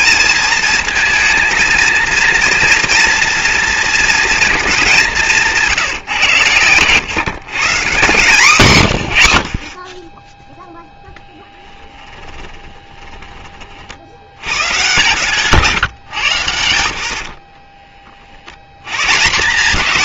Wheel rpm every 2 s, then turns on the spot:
230, 230, 170, 140, 90, 10, 20, 130, 90, 130.
4-6 12-14